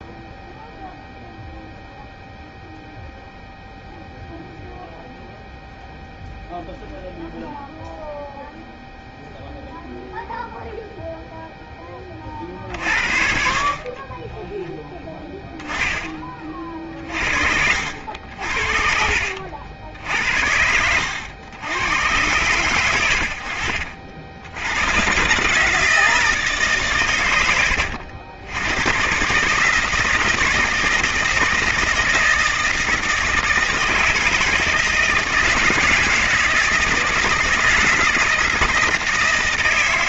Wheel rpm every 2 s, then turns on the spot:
0, 0, 0, 0, 0, 0, 40, 10, 40, 60, 80, 110, 110, 140, 110, 170, 160, 160, 160, 160.
14-16 18-20